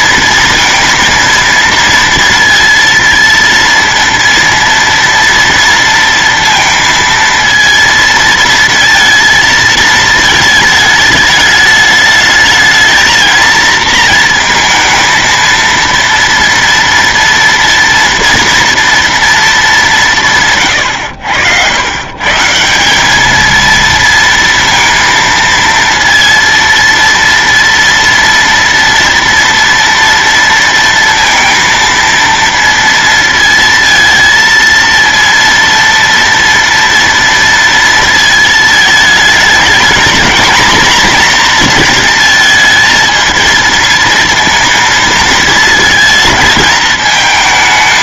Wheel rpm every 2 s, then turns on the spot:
230, 230, 230, 230, 230, 220, 220, 230, 230, 230, 130, 150, 230, 230, 230, 230, 230, 230, 230, 220, 240, 230, 230, 220.
none